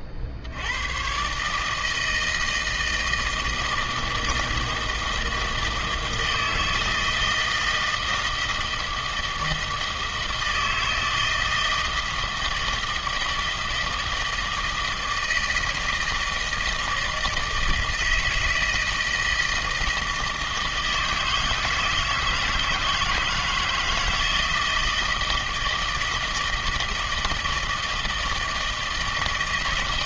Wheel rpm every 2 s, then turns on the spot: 70, 160, 160, 160, 160, 160, 160, 160, 160, 160, 160, 160, 160, 160, 160.
none